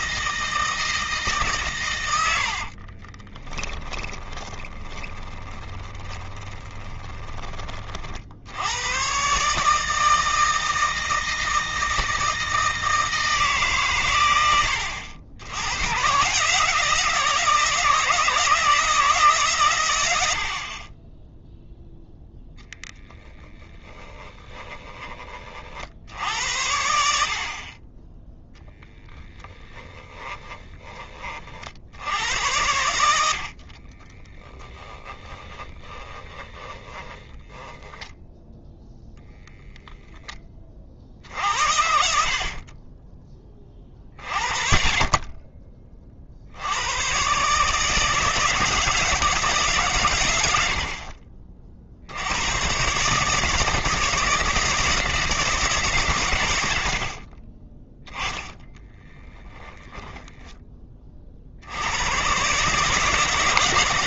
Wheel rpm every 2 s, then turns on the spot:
160, 40, 30, 20, 110, 160, 160, 100, 160, 160, 40, 10, 30, 80, 10, 20, 80, 10, 20, 0, 40, 30, 30, 100, 170, 60, 130, 160, 80, 10, 30, 150.
2-8 32-38 58-60